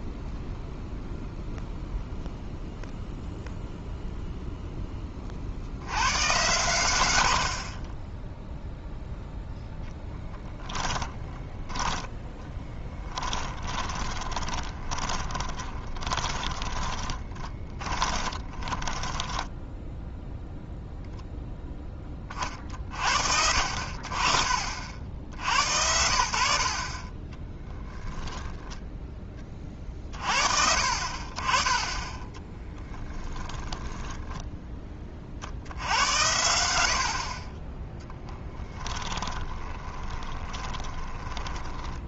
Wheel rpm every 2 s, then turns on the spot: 0, 0, 10, 100, 0, 20, 10, 30, 20, 20, 0, 40, 60, 50, 10, 50, 10, 10, 80, 10, 20.
10-20 32-34 38-42